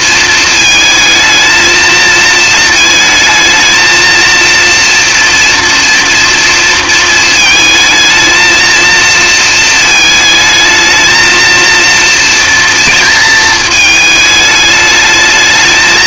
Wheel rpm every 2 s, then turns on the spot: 220, 220, 230, 230, 230, 220, 230, 210.
none